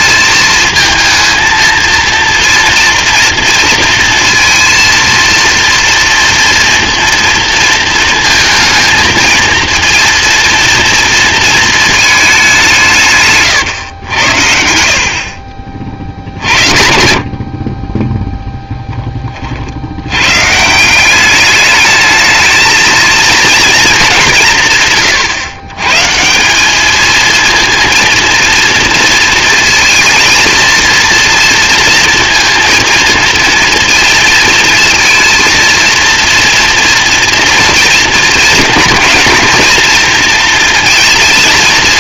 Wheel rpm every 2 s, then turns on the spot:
220, 230, 230, 230, 220, 240, 180, 80, 60, 10, 160, 220, 150, 200, 230, 230, 220, 230, 230, 220, 230.
none